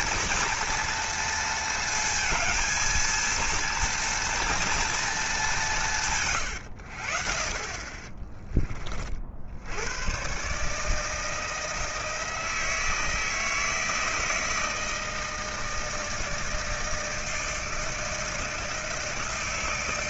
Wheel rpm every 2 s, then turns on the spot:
230, 230, 230, 100, 30, 140, 160, 160, 160, 160.
none